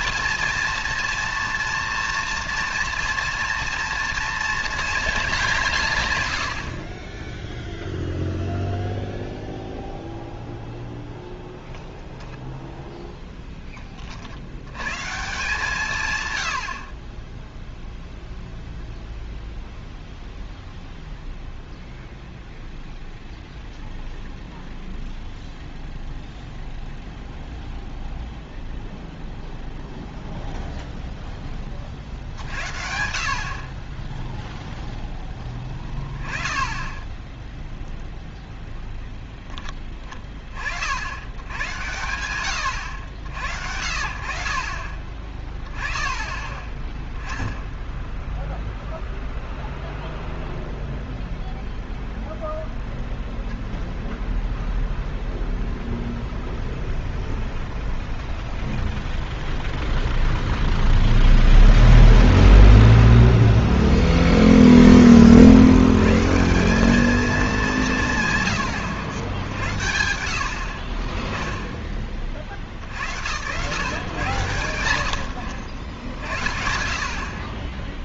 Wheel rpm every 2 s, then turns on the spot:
240, 230, 230, 130, 0, 0, 0, 70, 130, 0, 0, 0, 0, 0, 0, 0, 60, 10, 20, 0, 30, 100, 70, 20, 0, 0, 0, 0, 0, 0, 0, 0, 0, 150, 140, 70, 40, 130, 60.
none